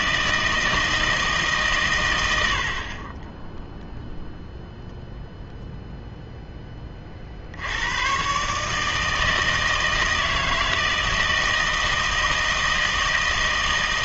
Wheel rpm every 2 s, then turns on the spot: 160, 70, 0, 10, 150, 160, 160.
none